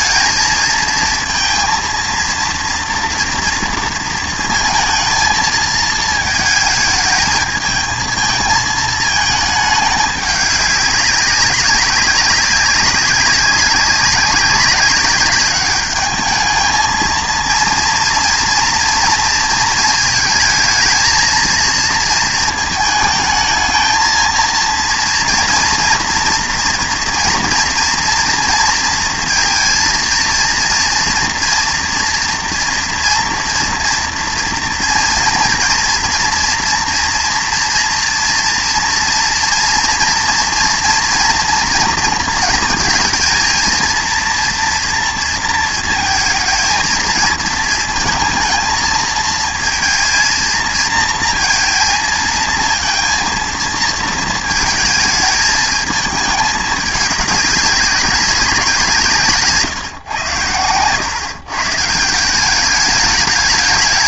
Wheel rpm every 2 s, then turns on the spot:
220, 230, 230, 220, 220, 200, 200, 190, 220, 230, 220, 230, 230, 240, 230, 230, 230, 230, 240, 230, 230, 220, 230, 220, 230, 230, 230, 220, 210, 180, 110, 200.
none